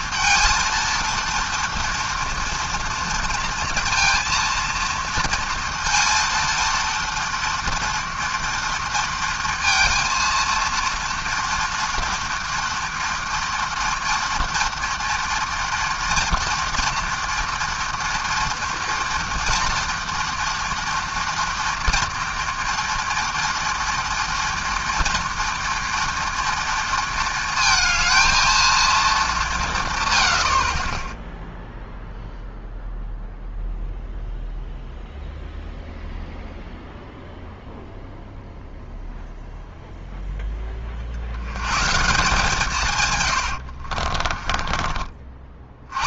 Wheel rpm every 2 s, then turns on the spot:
230, 230, 230, 230, 230, 230, 230, 230, 230, 230, 230, 230, 230, 230, 220, 70, 0, 0, 0, 0, 10, 160, 30.
44-46